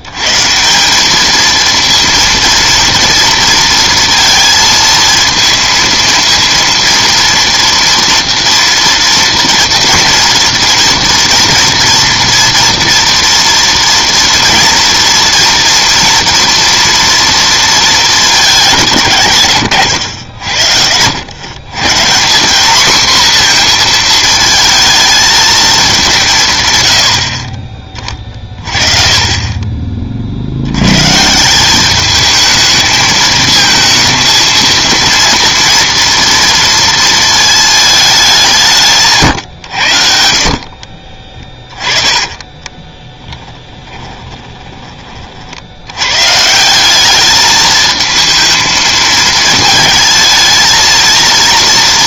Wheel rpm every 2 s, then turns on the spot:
170, 230, 230, 230, 240, 230, 230, 230, 230, 170, 70, 220, 220, 130, 30, 90, 220, 230, 230, 160, 40, 20, 20, 180, 220, 220.
40-44